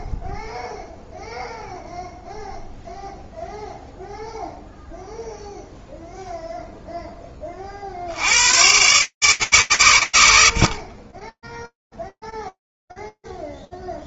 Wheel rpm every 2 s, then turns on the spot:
0, 0, 0, 30, 140, 10, 0.
none